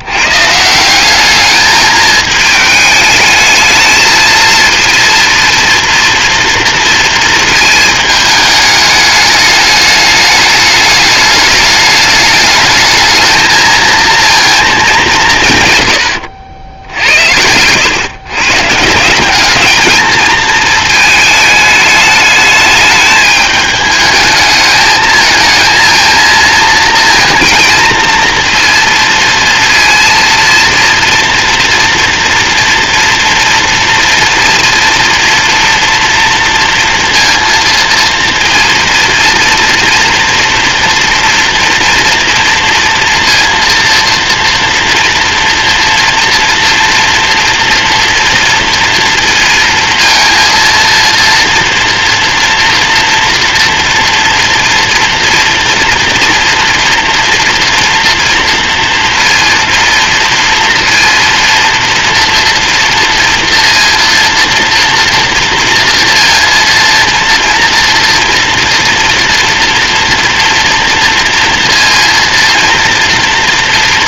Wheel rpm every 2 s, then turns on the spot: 210, 210, 230, 230, 210, 210, 220, 140, 100, 200, 220, 210, 220, 230, 230, 230, 240, 240, 230, 230, 230, 230, 230, 230, 230, 240, 230, 230, 230, 230, 230, 230, 230, 230, 230, 230, 230.
none